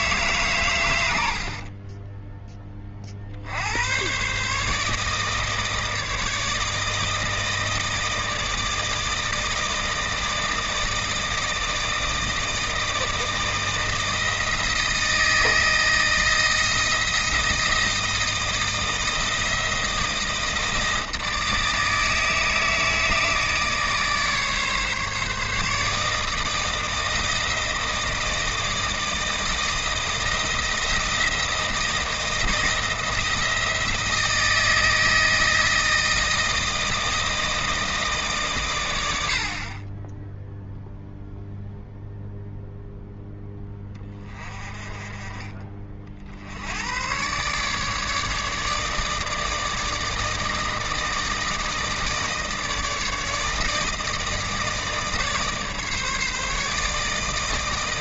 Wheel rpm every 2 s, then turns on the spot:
70, 50, 160, 160, 160, 160, 160, 160, 170, 160, 160, 160, 150, 170, 160, 170, 160, 160, 160, 90, 0, 0, 30, 110, 150, 160, 160, 160, 160.
none